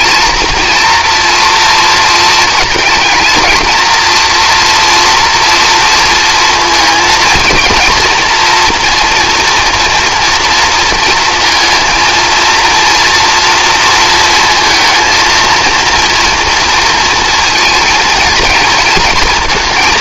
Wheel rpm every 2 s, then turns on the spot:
230, 220, 230, 230, 240, 230, 230, 230, 230, 230.
none